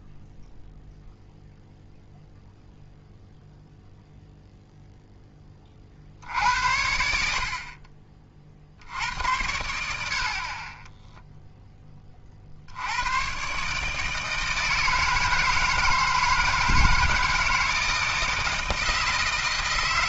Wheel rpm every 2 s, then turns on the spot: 0, 0, 0, 60, 50, 20, 70, 160, 160, 160.
none